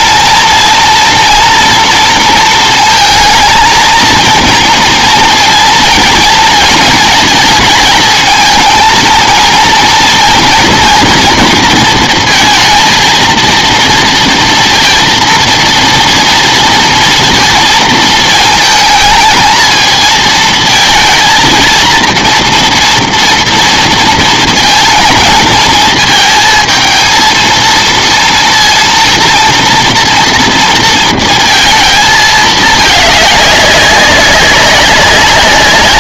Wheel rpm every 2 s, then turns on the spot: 230, 230, 230, 230, 230, 230, 230, 230, 230, 220, 220, 230, 230, 230, 230, 230, 220, 200.
none